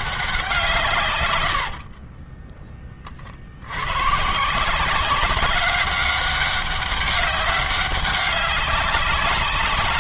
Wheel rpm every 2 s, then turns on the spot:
140, 30, 180, 200, 200.
none